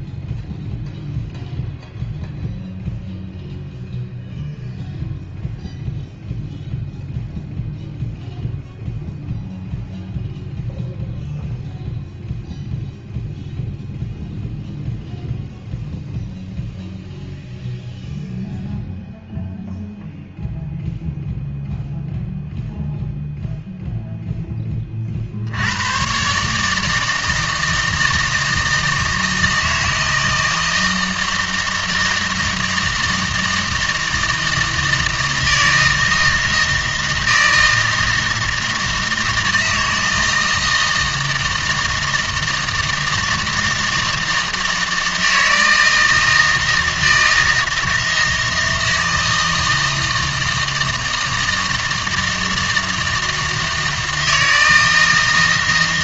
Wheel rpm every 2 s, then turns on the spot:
0, 0, 0, 0, 0, 0, 0, 0, 0, 0, 0, 0, 10, 150, 160, 160, 160, 160, 160, 160, 160, 160, 160, 160, 160, 160, 160, 160.
none